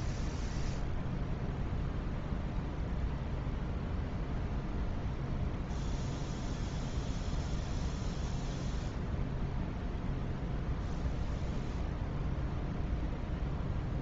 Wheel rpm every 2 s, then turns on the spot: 0, 0, 0, 0, 0, 0, 0.
none